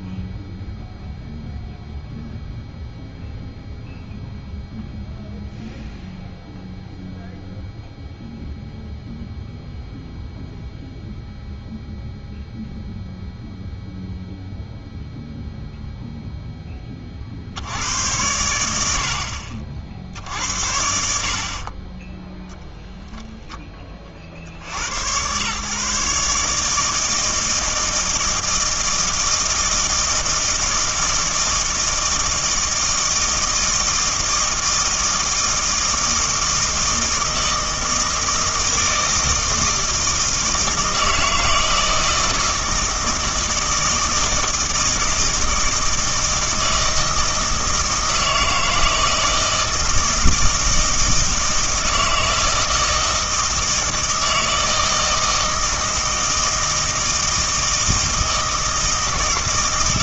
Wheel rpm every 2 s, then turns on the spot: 0, 0, 0, 0, 0, 0, 0, 0, 10, 90, 60, 0, 90, 150, 160, 160, 160, 160, 160, 160, 160, 160, 160, 160, 160, 160, 160, 160, 160, 160.
none